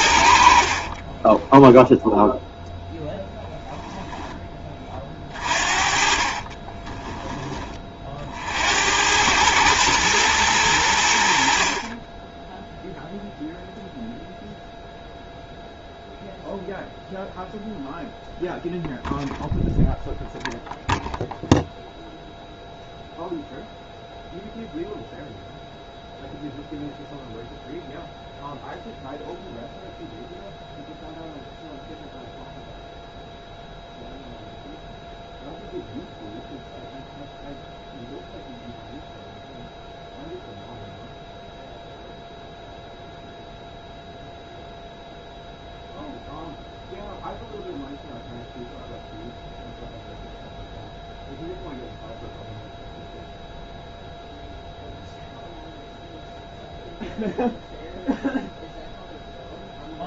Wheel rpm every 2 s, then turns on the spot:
50, 0, 10, 30, 70, 100, 0, 0, 0, 0, 0, 0, 0, 0, 0, 0, 0, 0, 0, 0, 0, 0, 0, 0, 0, 0, 0, 0, 0, 0.
6-8